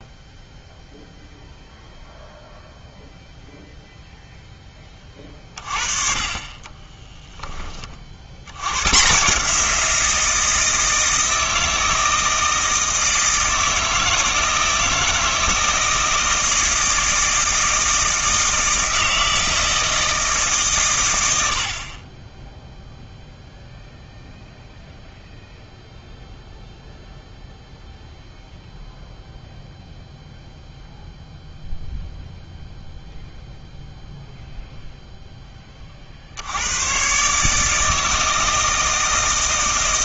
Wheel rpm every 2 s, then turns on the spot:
0, 0, 20, 20, 110, 160, 160, 160, 160, 160, 120, 0, 0, 0, 0, 0, 0, 0, 100, 160.
6-8